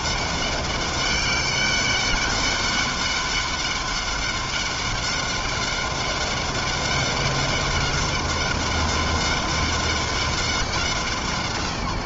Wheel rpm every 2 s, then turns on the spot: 200, 200, 200, 200, 200, 140.
none